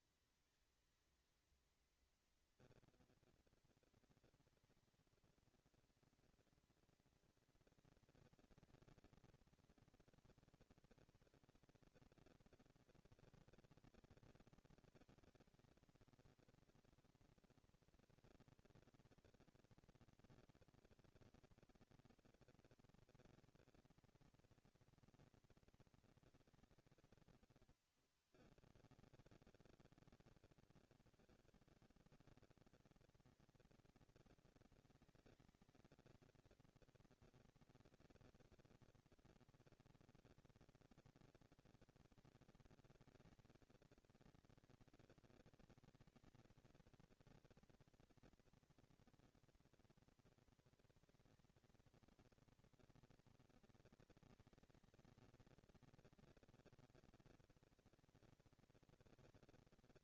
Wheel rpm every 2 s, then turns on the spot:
230, 240, 230, 230, 230, 230, 230, 230, 230, 230, 230, 230, 230, 220, 170, 160, 190, 220, 230, 240, 230, 230, 230, 220, 230, 230, 230, 220, 230, 230.
none